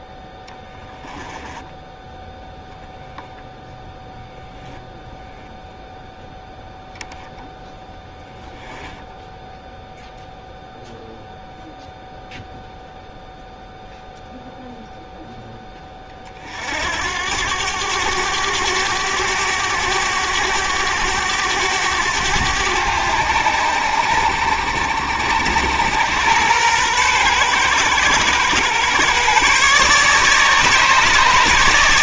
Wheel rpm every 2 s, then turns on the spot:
10, 0, 0, 0, 0, 0, 0, 0, 60, 100, 100, 100, 80, 110, 120, 150.
0-2